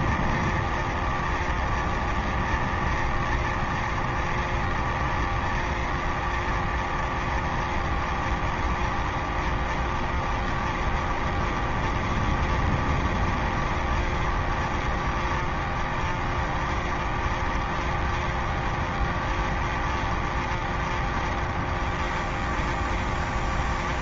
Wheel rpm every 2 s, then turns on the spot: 0, 0, 0, 0, 0, 0, 0, 0, 0, 0, 0, 0.
none